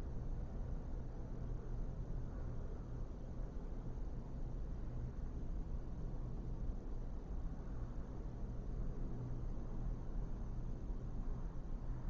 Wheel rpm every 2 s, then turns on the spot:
0, 0, 0, 0, 0, 0.
none